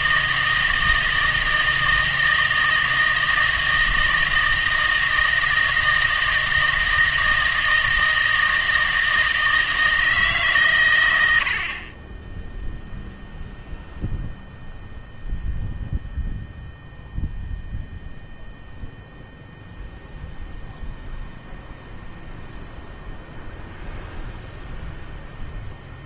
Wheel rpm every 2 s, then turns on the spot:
160, 160, 160, 160, 160, 140, 0, 0, 0, 0, 0, 0, 0.
none